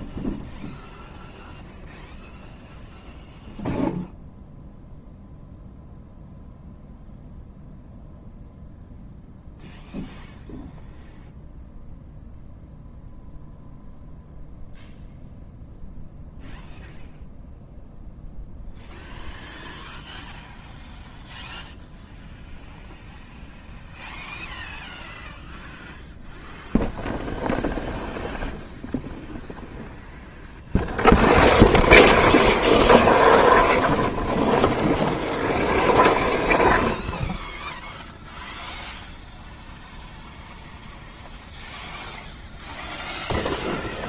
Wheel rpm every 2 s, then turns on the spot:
0, 0, 0, 0, 0, 0, 0, 0, 0, 0, 0, 0, 0, 0, 0, 0, 0, 0, 0, 0, 0, 0.
none